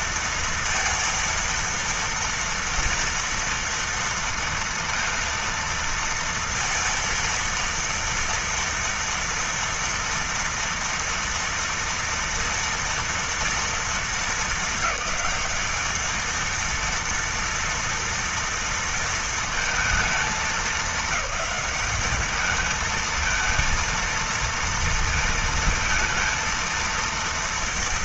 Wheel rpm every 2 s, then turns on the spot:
230, 230, 230, 230, 230, 230, 230, 210, 230, 230, 220, 220, 230, 230.
none